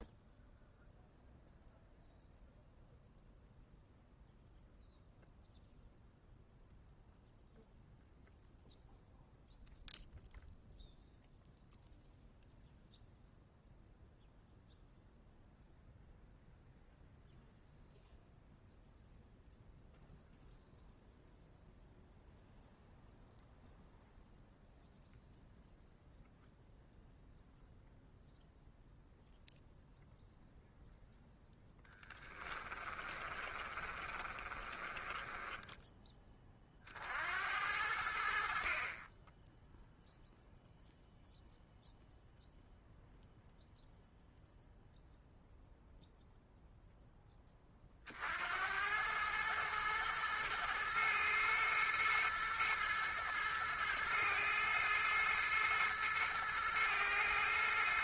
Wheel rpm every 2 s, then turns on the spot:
0, 0, 0, 0, 0, 0, 0, 0, 0, 0, 0, 0, 0, 0, 0, 0, 20, 30, 30, 50, 0, 0, 0, 0, 80, 110, 110, 110, 110.
32-36